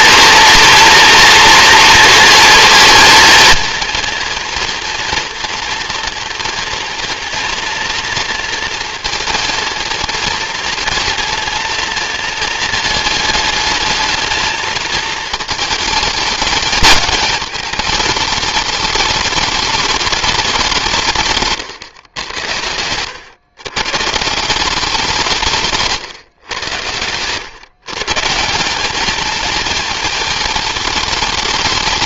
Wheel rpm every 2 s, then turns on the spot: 230, 230, 230, 240, 230, 230, 220, 220, 220, 210, 180, 90, 190, 100, 200, 220.
none